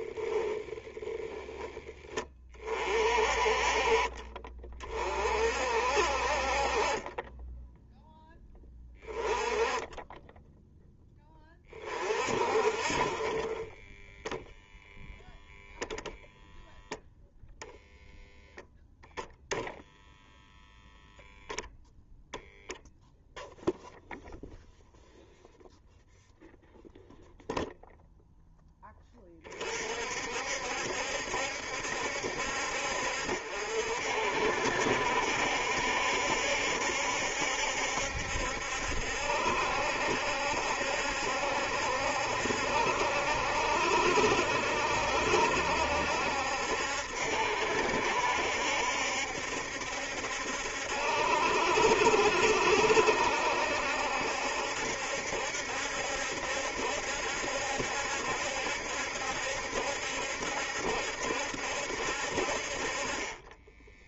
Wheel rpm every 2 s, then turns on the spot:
10, 40, 30, 40, 20, 10, 40, 0, 0, 0, 0, 0, 0, 0, 10, 70, 60, 70, 70, 70, 70, 70, 70, 70, 70, 70, 70, 70, 70, 70, 70, 40.
none